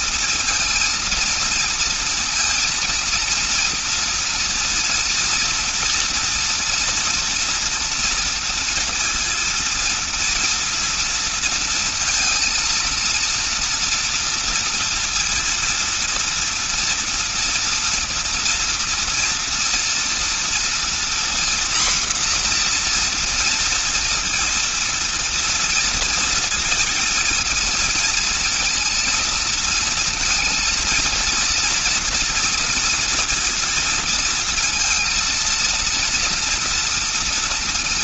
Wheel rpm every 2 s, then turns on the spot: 230, 230, 230, 230, 230, 230, 230, 230, 230, 230, 240, 240, 230, 230, 230, 230, 230, 230, 230.
none